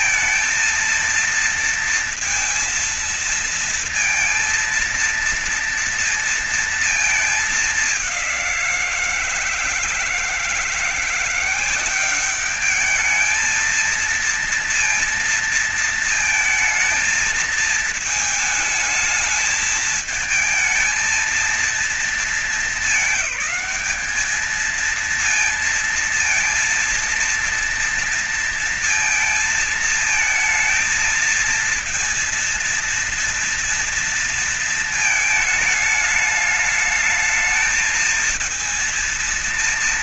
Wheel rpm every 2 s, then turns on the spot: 230, 230, 230, 230, 170, 170, 210, 230, 220, 220, 220, 220, 220, 230, 230, 220, 230, 230, 210, 230.
none